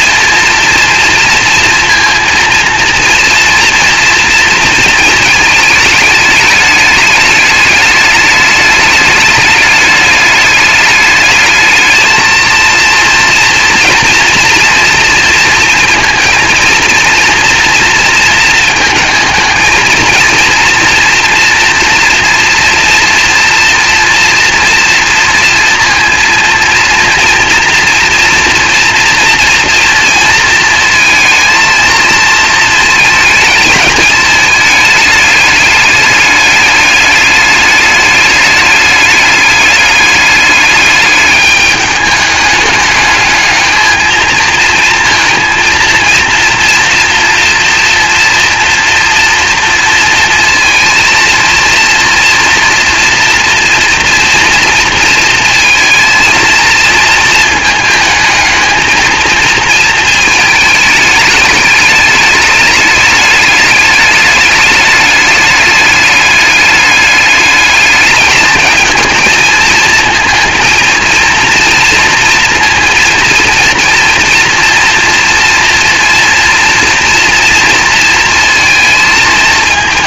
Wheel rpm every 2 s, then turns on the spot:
230, 230, 220, 210, 210, 210, 230, 230, 230, 220, 230, 240, 230, 230, 230, 230, 220, 210, 210, 210, 210, 210, 230, 230, 230, 230, 240, 230, 230, 220, 210, 210, 200, 210, 220, 230, 230, 230, 230, 220.
none